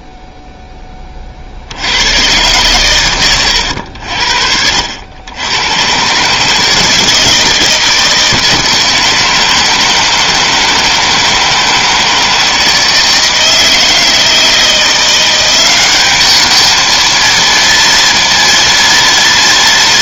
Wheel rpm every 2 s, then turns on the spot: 0, 90, 70, 120, 160, 160, 160, 160, 200, 230.
none